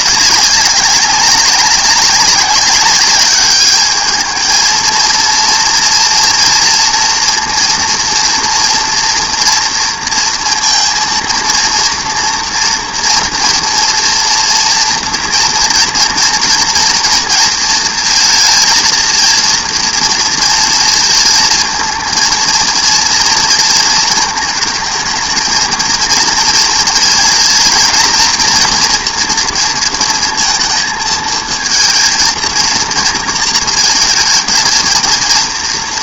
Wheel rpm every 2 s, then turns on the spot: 190, 190, 220, 230, 230, 230, 230, 230, 230, 230, 230, 230, 220, 230, 230, 230, 230, 220.
none